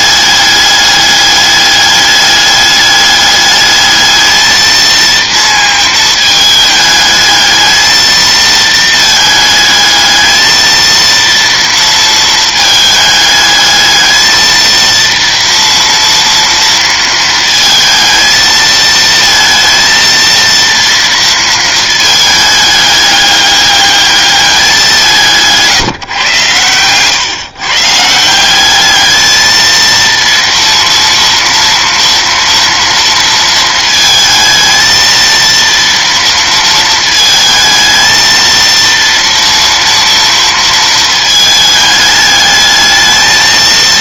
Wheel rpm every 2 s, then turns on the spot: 210, 210, 220, 210, 220, 220, 220, 230, 230, 220, 230, 210, 200, 120, 190, 230, 230, 220, 230, 230, 230, 210.
none